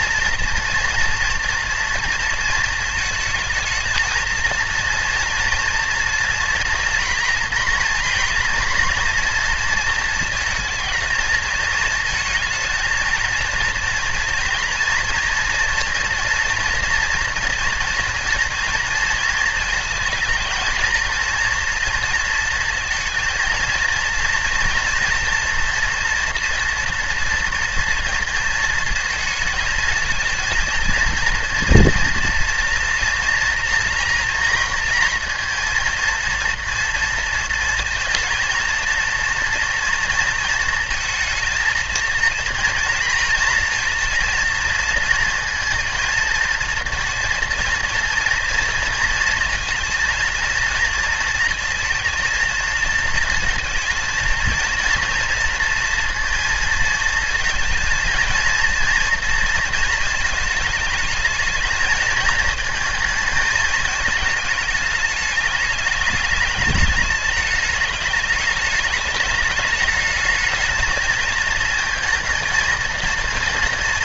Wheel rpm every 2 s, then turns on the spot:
230, 230, 230, 240, 230, 230, 230, 240, 230, 230, 230, 230, 230, 230, 230, 230, 240, 230, 230, 230, 220, 230, 230, 230, 230, 230, 230, 230, 230, 230, 220, 220, 210, 210, 210, 220, 230.
none